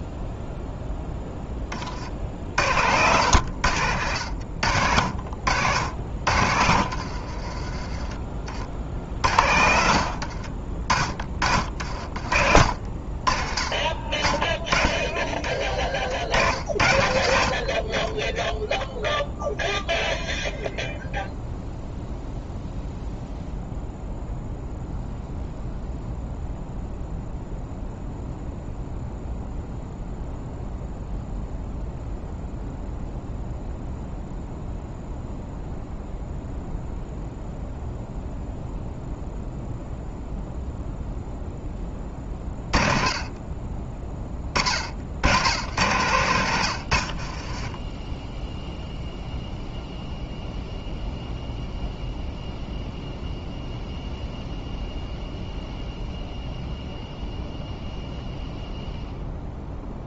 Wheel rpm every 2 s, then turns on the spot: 0, 70, 70, 70, 50, 60, 50, 20, 70, 0, 0, 0, 0, 0, 0, 0, 0, 0, 0, 0, 0, 40, 30, 100, 0, 0, 0, 0, 0, 0.
6-8 14-16